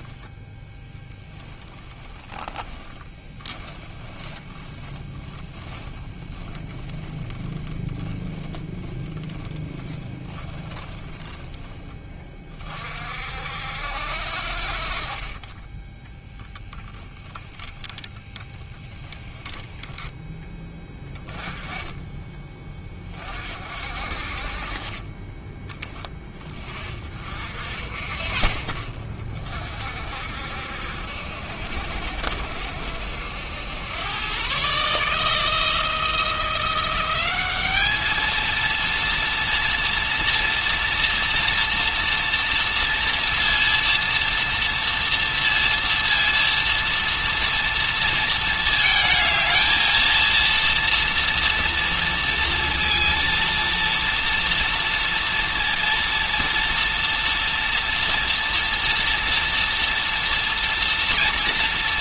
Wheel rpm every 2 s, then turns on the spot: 0, 10, 10, 10, 10, 10, 40, 50, 10, 10, 20, 20, 40, 20, 50, 70, 70, 140, 180, 230, 230, 230, 230, 230, 220, 230, 230, 230, 230, 230, 230.
4-6 8-12 18-20